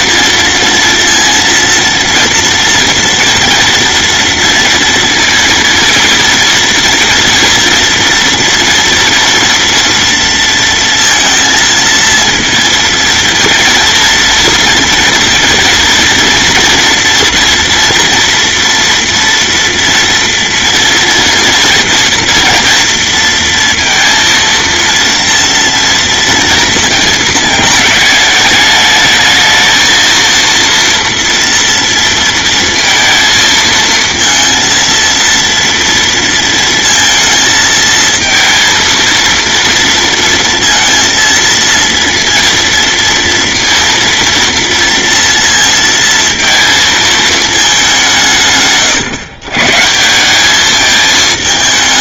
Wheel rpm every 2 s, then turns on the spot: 230, 230, 230, 230, 240, 230, 230, 230, 230, 240, 230, 230, 230, 230, 220, 230, 230, 230, 230, 230, 230, 230, 230, 230, 150, 200.
none